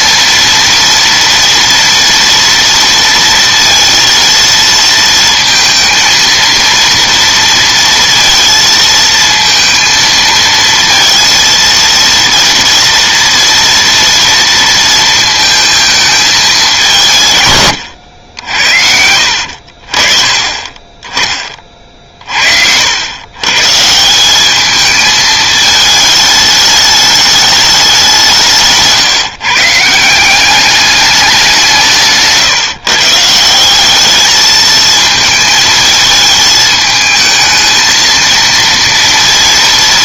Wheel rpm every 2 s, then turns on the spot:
230, 230, 230, 230, 230, 230, 230, 230, 190, 80, 30, 80, 210, 210, 150, 200, 140, 220, 220, 230.
none